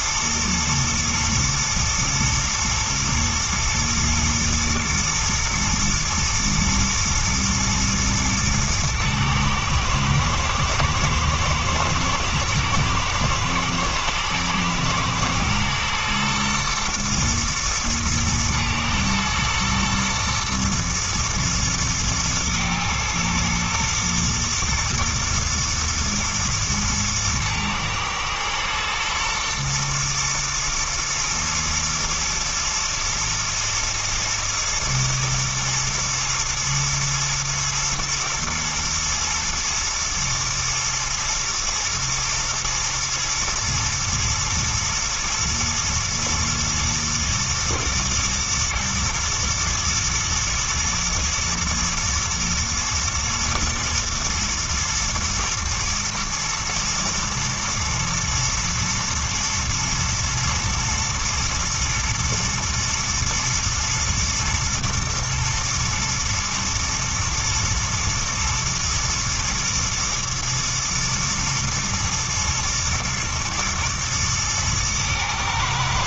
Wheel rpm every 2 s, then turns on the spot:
120, 110, 110, 110, 110, 110, 120, 110, 120, 110, 110, 110, 110, 110, 110, 110, 110, 110, 110, 110, 110, 120, 110, 110, 110, 110, 120, 120, 110, 120, 110, 110, 120, 110, 110, 110, 110, 110.
none